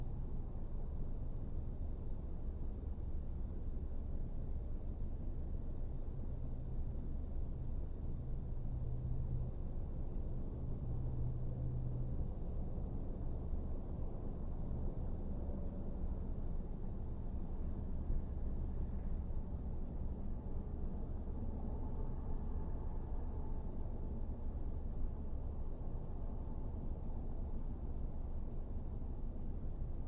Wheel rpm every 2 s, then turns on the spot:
0, 0, 0, 0, 0, 0, 0, 0, 0, 0, 0, 0, 0, 0, 0.
none